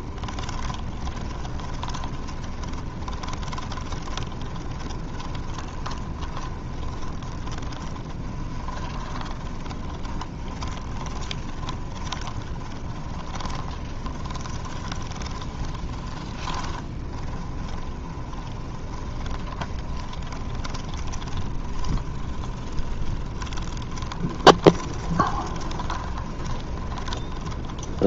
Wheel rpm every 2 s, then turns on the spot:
20, 20, 20, 20, 20, 20, 20, 20, 20, 20, 30, 20, 20, 20.
0-28